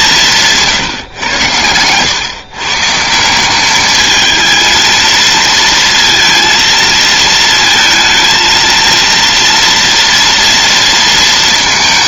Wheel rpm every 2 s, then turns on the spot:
150, 140, 220, 230, 230, 230.
none